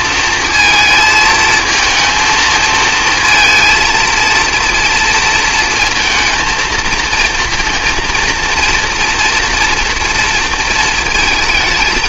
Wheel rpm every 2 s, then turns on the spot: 220, 220, 230, 230, 230, 220.
none